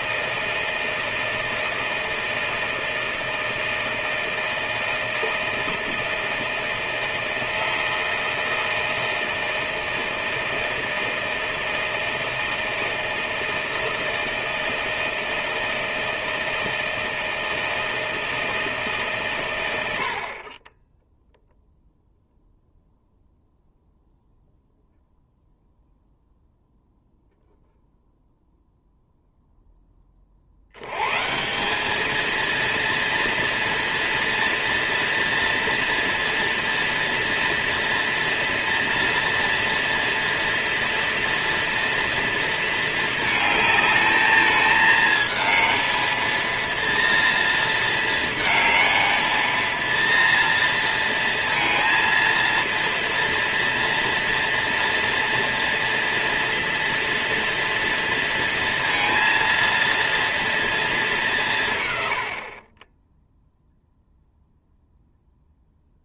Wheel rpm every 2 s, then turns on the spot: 160, 160, 160, 160, 160, 160, 160, 160, 160, 140, 10, 0, 0, 0, 0, 130, 230, 230, 230, 230, 230, 220, 220, 230, 220, 230, 230, 230, 230, 230, 210, 20, 0.
none